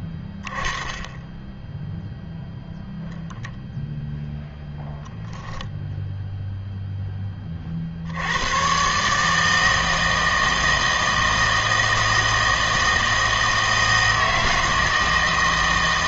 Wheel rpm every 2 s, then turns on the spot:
10, 0, 0, 0, 110, 160, 160, 160.
none